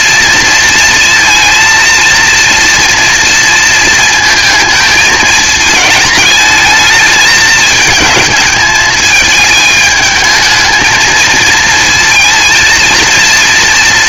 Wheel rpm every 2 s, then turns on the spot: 220, 230, 220, 220, 210, 220, 230.
none